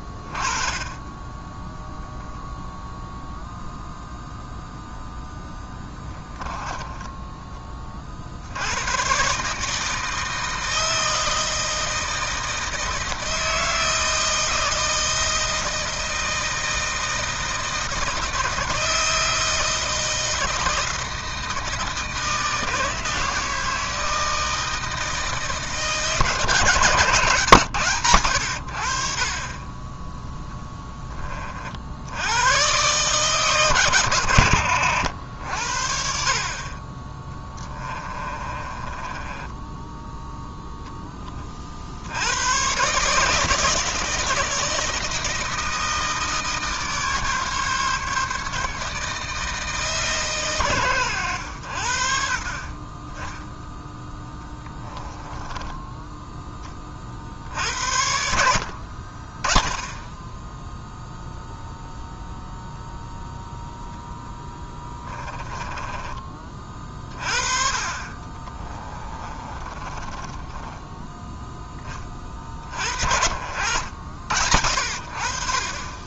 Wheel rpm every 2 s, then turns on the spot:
20, 0, 0, 20, 110, 160, 160, 160, 160, 160, 160, 160, 160, 150, 70, 10, 120, 70, 30, 20, 10, 130, 160, 150, 150, 120, 30, 20, 20, 60, 10, 0, 10, 30, 30, 10, 50, 70.
6-8 38-40 52-56 64-66 68-72